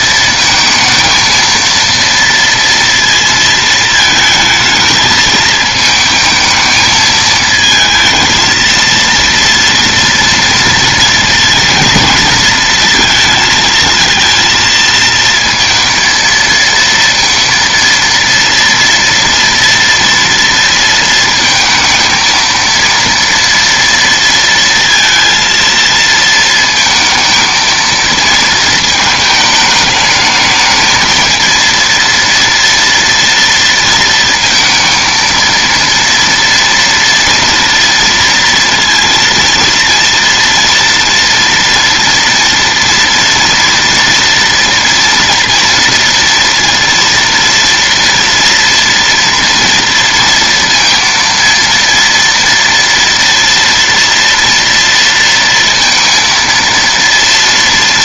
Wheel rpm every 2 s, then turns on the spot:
230, 230, 220, 220, 230, 230, 230, 230, 230, 230, 230, 230, 230, 220, 220, 220, 230, 230, 230, 230, 230, 230, 230, 230, 240, 230, 230, 230, 230.
none